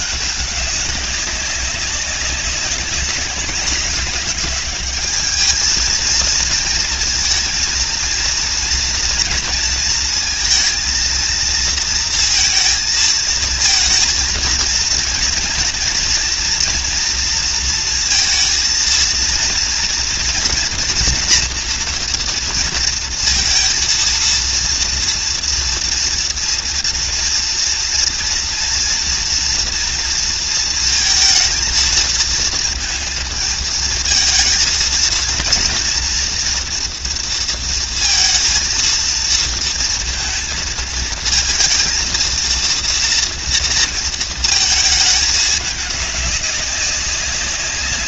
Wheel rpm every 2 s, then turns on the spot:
200, 190, 210, 230, 230, 230, 230, 230, 230, 230, 230, 230, 230, 230, 230, 230, 230, 220, 230, 230, 230, 230, 220, 200.
none